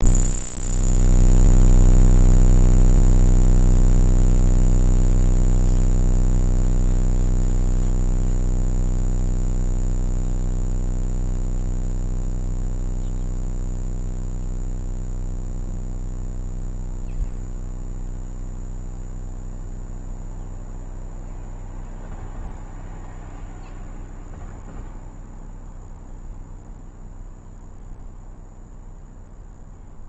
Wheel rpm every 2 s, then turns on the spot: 0, 0, 0, 0, 0, 0, 0, 0, 0, 0, 0, 0, 0, 0, 0.
none